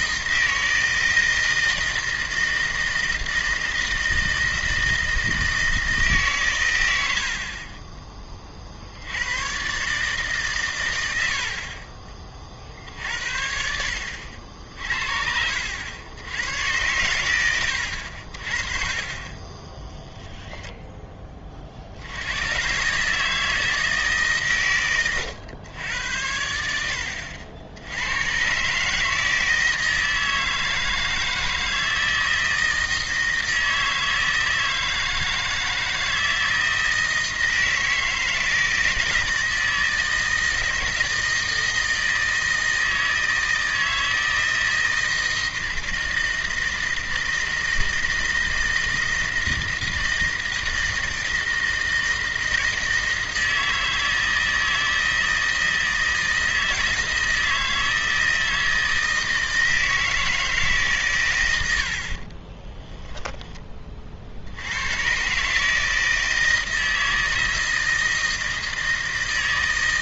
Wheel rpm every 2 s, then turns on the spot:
160, 160, 160, 110, 50, 110, 60, 60, 110, 40, 0, 120, 130, 80, 140, 160, 160, 160, 160, 160, 160, 160, 160, 160, 160, 160, 160, 160, 160, 160, 140, 20, 100, 160, 160.
18-20 62-64